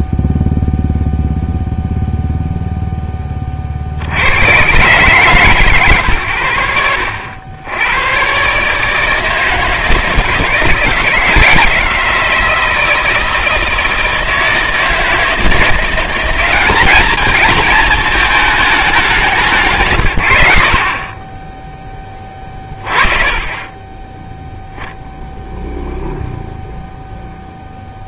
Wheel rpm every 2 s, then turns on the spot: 0, 0, 110, 90, 140, 170, 160, 160, 200, 220, 70, 20, 0, 0.
none